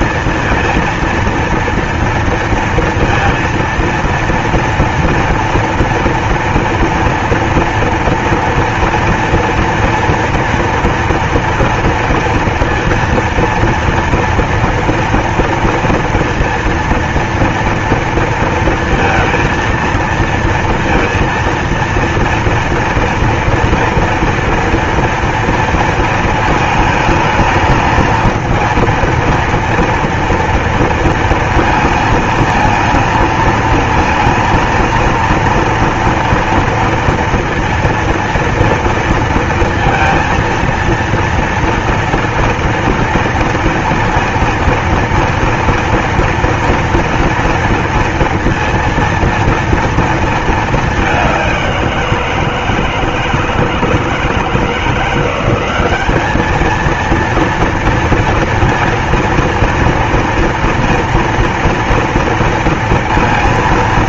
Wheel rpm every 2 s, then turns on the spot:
230, 230, 230, 230, 230, 230, 230, 240, 230, 230, 230, 230, 230, 220, 230, 230, 220, 230, 230, 230, 230, 230, 230, 230, 230, 220, 160, 160, 220, 230, 230, 230.
none